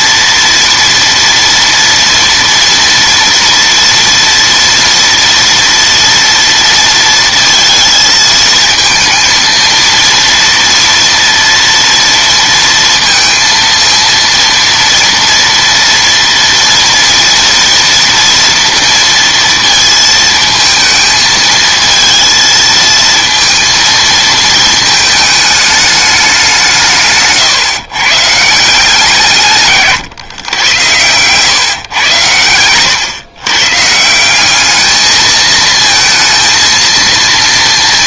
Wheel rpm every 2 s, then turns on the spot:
230, 240, 230, 230, 220, 230, 230, 230, 230, 230, 220, 230, 220, 170, 160, 110, 120, 210, 230.
32-34